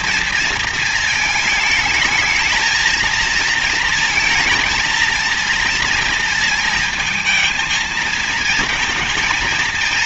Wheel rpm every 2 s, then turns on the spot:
220, 220, 220, 220, 220.
none